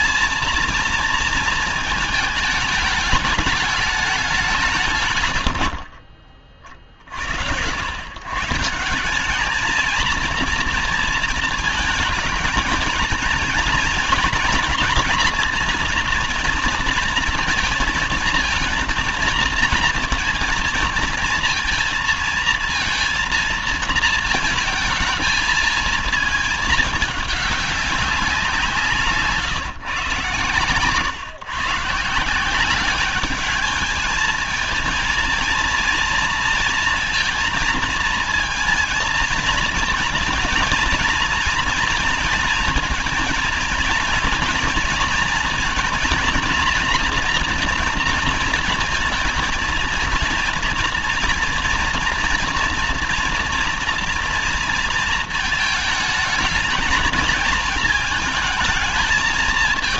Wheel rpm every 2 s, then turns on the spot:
230, 220, 160, 30, 140, 230, 220, 230, 230, 230, 230, 230, 220, 210, 180, 140, 180, 220, 230, 230, 230, 230, 240, 230, 230, 230, 230, 230, 220, 220.
none